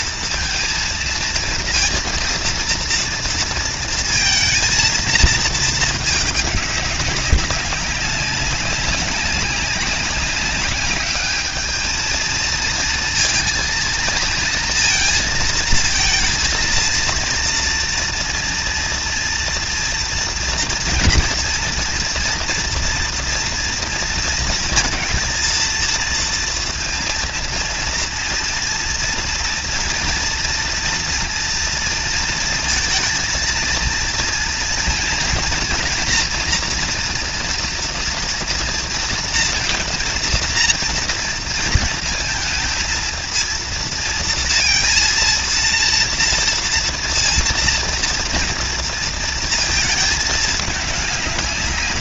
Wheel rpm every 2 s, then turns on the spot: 230, 230, 220, 200, 190, 200, 230, 230, 230, 230, 240, 230, 230, 230, 230, 230, 230, 230, 230, 230, 230, 220, 230, 230, 230, 210.
none